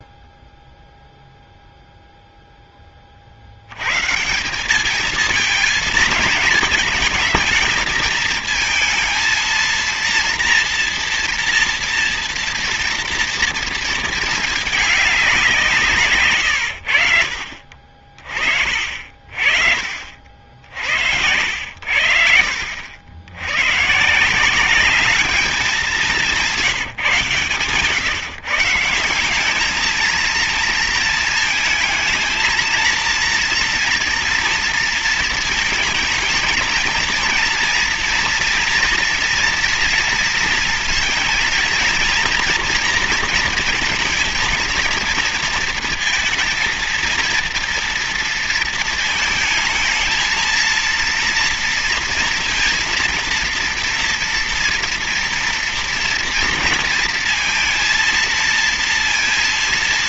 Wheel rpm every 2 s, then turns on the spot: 0, 10, 180, 220, 220, 240, 230, 210, 90, 40, 70, 70, 190, 180, 150, 230, 230, 230, 230, 230, 230, 230, 230, 230, 230, 230, 230, 230, 230, 230.
none